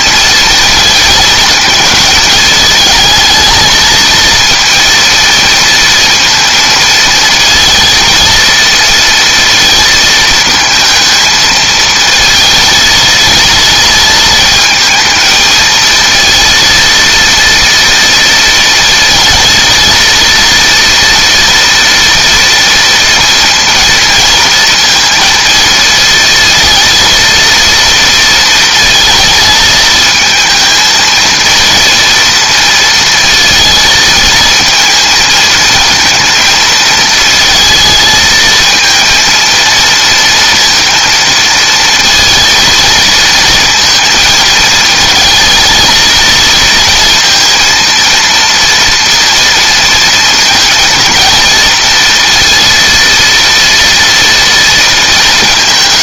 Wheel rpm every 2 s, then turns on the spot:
230, 220, 230, 230, 230, 220, 220, 220, 230, 230, 230, 230, 230, 230, 230, 220, 230, 220, 230, 230, 230, 230, 220, 230, 230, 230, 230, 230.
none